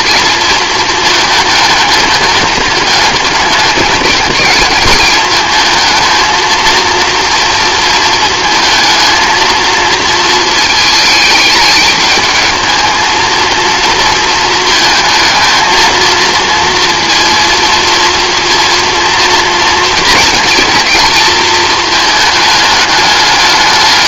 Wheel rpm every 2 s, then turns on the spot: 230, 210, 210, 230, 220, 220, 220, 220, 230, 230, 230, 210.
none